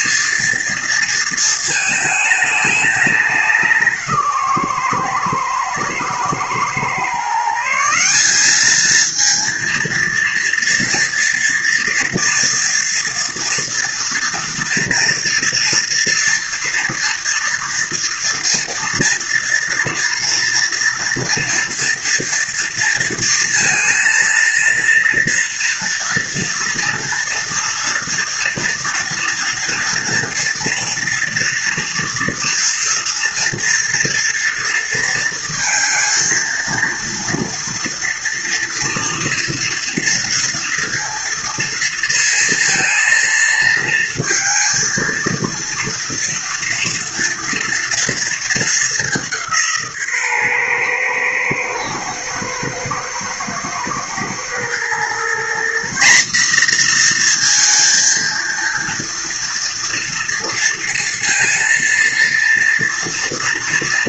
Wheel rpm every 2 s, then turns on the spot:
230, 210, 130, 110, 200, 230, 230, 240, 230, 230, 230, 230, 230, 230, 240, 230, 230, 230, 230, 230, 230, 230, 230, 230, 210, 130, 110, 120, 220, 230, 230, 230.
none